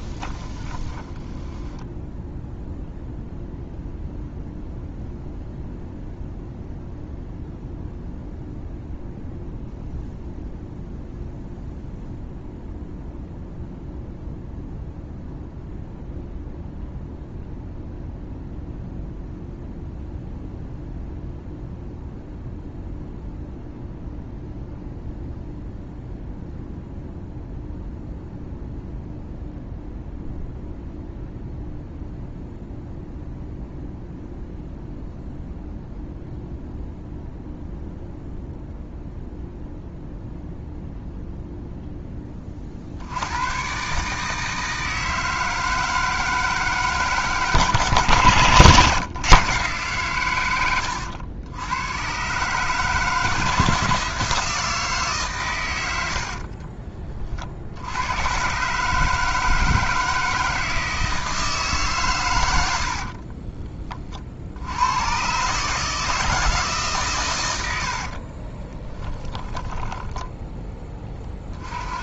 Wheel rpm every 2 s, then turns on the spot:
20, 0, 0, 0, 0, 0, 0, 0, 0, 0, 0, 0, 0, 0, 0, 0, 0, 0, 0, 0, 0, 50, 160, 150, 130, 100, 150, 160, 40, 150, 160, 70, 90, 150, 20, 10.
0-2 56-58 68-70